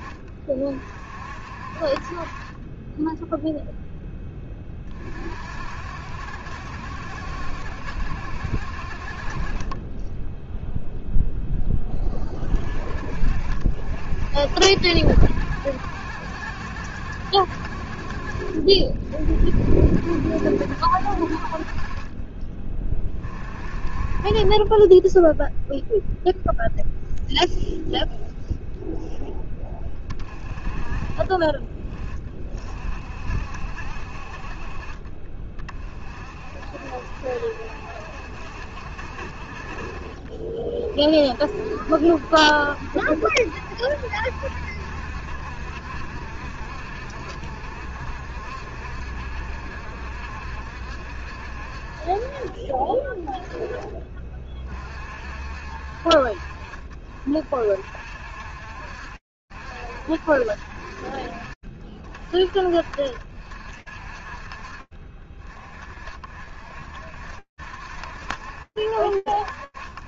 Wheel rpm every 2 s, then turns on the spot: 40, 20, 30, 70, 60, 0, 40, 60, 70, 40, 60, 30, 20, 0, 0, 20, 40, 30, 50, 50, 40, 60, 60, 60, 60, 60, 30, 40, 40, 60, 40, 40, 40, 70, 60.
none